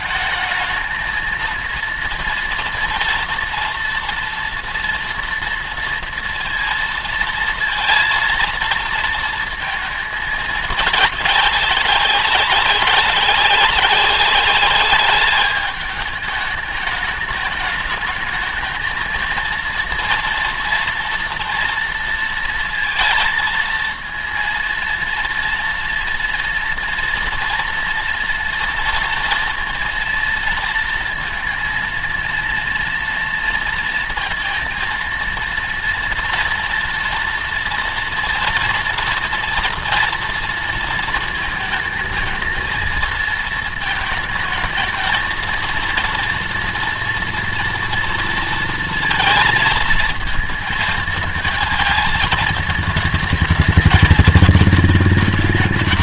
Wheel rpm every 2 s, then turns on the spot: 220, 230, 230, 230, 230, 210, 190, 200, 210, 220, 230, 230, 230, 240, 230, 230, 230, 230, 230, 240, 230, 230, 220, 230, 230, 220, 220, 220.
none